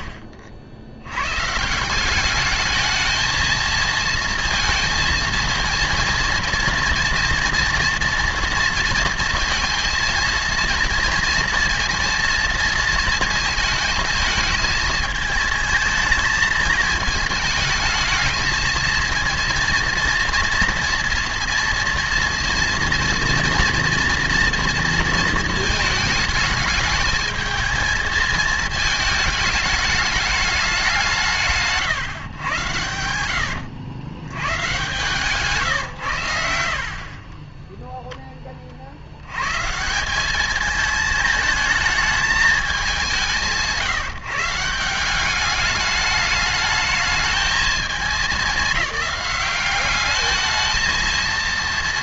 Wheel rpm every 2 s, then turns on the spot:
90, 220, 230, 230, 230, 230, 220, 220, 220, 220, 230, 230, 230, 220, 220, 180, 80, 130, 50, 80, 220, 190, 180, 210, 200, 220.
none